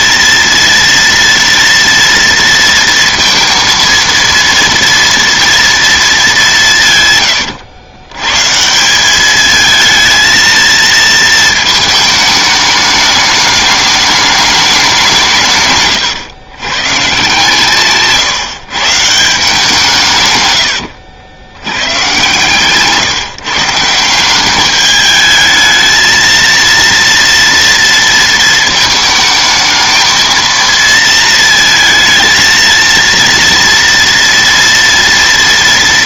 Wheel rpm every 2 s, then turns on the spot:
230, 230, 230, 170, 170, 230, 210, 200, 130, 150, 100, 140, 200, 230, 220, 230, 230, 240.
none